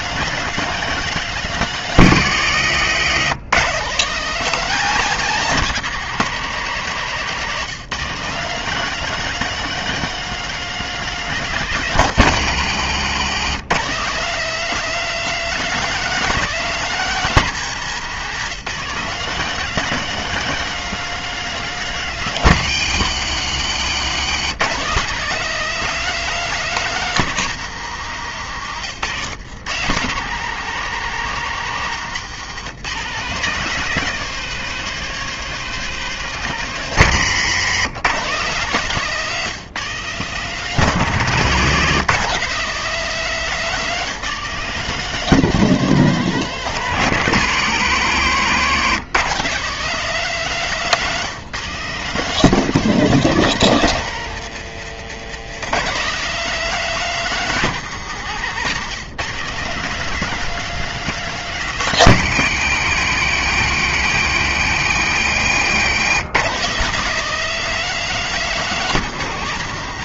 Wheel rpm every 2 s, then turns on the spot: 220, 180, 200, 150, 200, 220, 160, 200, 200, 170, 220, 160, 170, 200, 120, 150, 170, 210, 180, 170, 180, 190, 180, 180, 160, 180, 200, 140, 200, 150, 210, 150, 150, 180, 200.
58-60